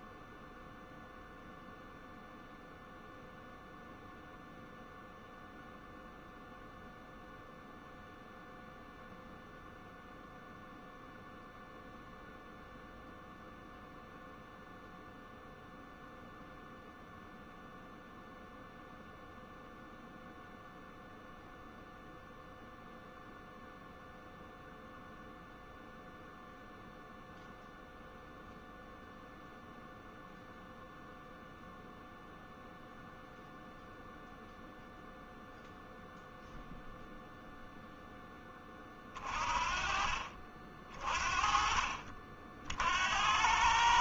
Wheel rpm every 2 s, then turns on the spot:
0, 0, 0, 0, 0, 0, 0, 0, 0, 0, 0, 0, 0, 0, 0, 0, 0, 0, 0, 30, 40, 70.
none